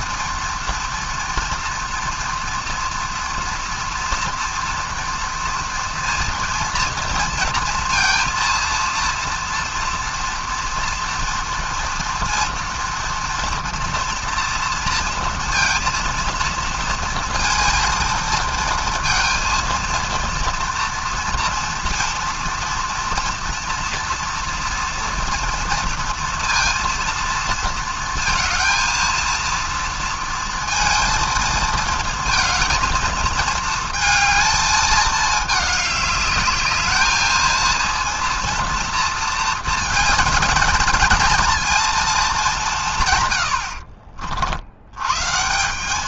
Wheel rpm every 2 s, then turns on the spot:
230, 230, 230, 230, 230, 230, 230, 230, 230, 230, 230, 230, 230, 230, 220, 230, 220, 220, 210, 230, 210, 200, 70.
none